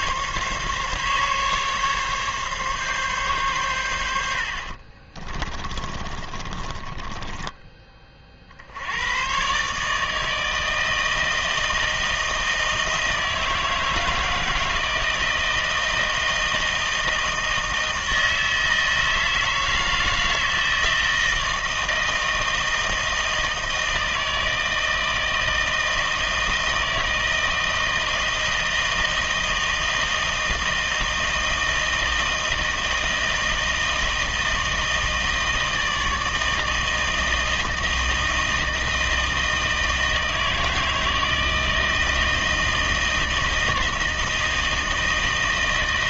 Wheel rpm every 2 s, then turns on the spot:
140, 140, 60, 30, 60, 160, 160, 160, 160, 160, 160, 160, 160, 160, 160, 160, 160, 160, 160, 160, 160, 160, 160.
6-8